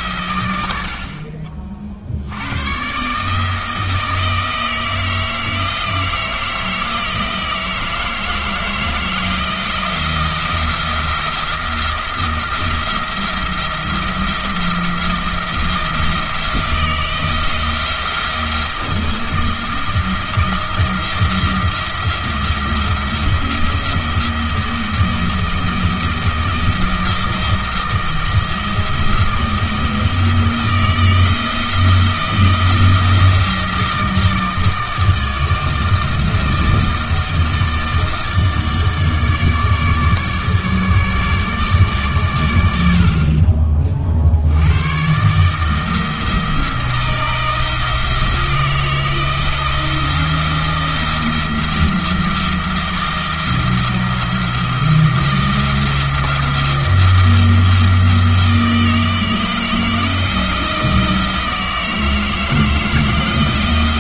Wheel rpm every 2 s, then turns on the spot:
80, 120, 160, 160, 160, 170, 170, 170, 170, 170, 170, 170, 170, 170, 160, 160, 160, 160, 160, 150, 150, 80, 100, 160, 170, 170, 170, 170, 170, 160, 160, 160.
none